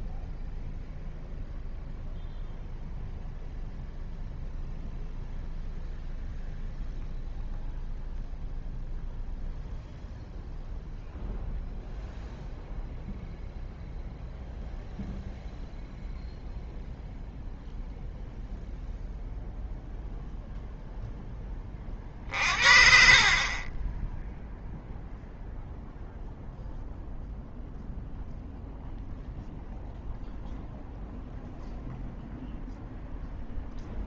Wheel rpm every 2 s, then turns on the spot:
0, 0, 0, 0, 0, 0, 0, 0, 0, 0, 0, 50, 0, 0, 0, 0, 0.
none